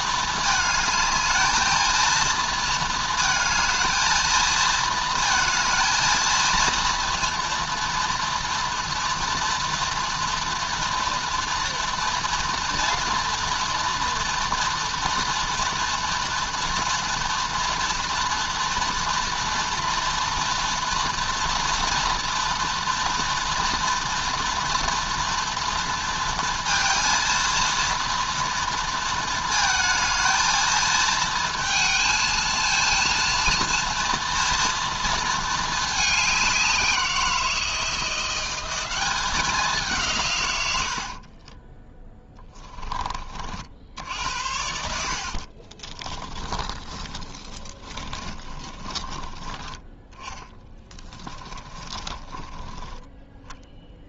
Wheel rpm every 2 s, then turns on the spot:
220, 220, 230, 230, 230, 230, 230, 230, 230, 230, 230, 230, 230, 230, 230, 220, 230, 230, 180, 190, 70, 20, 70, 20, 20, 20, 20.
40-42 44-52